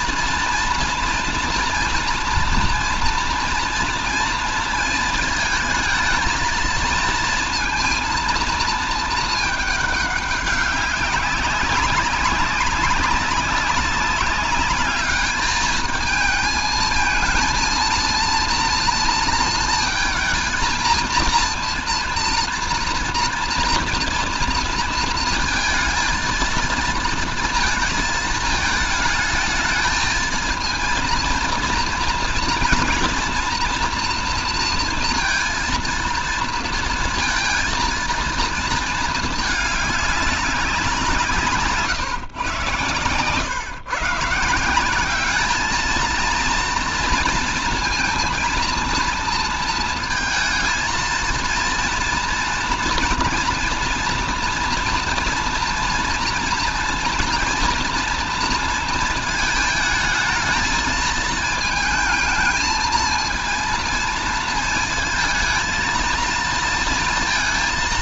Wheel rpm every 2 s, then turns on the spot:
230, 230, 230, 230, 230, 200, 200, 210, 220, 230, 230, 230, 230, 230, 220, 230, 240, 230, 230, 230, 190, 120, 180, 230, 230, 230, 230, 230, 240, 230, 220, 220, 230, 230.
none